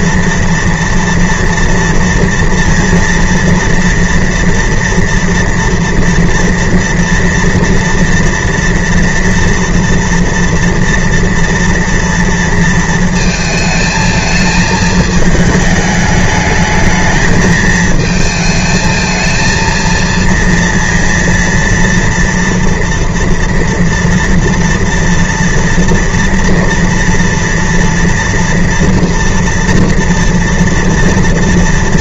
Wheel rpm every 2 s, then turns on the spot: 230, 230, 240, 240, 230, 230, 230, 220, 210, 220, 230, 230, 230, 230, 230, 230.
none